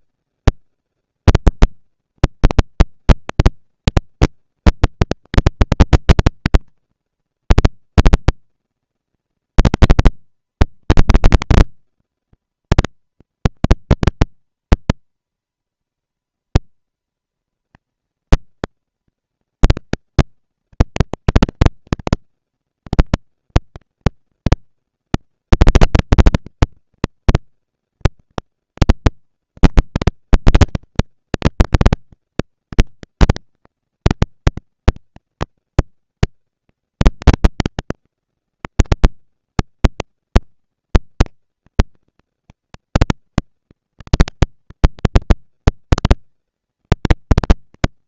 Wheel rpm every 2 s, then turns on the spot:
230, 230, 230, 230, 230, 230, 230, 230, 230, 230, 230, 240, 230, 230, 230, 230, 230, 230, 200, 200, 220, 240, 240, 220.
none